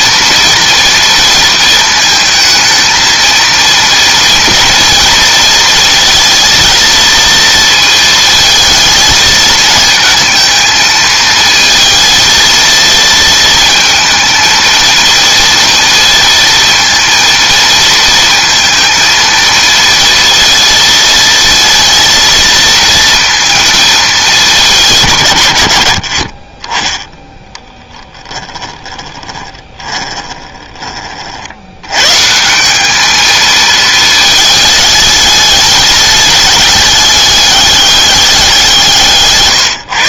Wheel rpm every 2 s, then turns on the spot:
230, 220, 230, 230, 220, 220, 230, 230, 230, 230, 230, 220, 200, 20, 20, 20, 180, 220, 210, 180.
28-32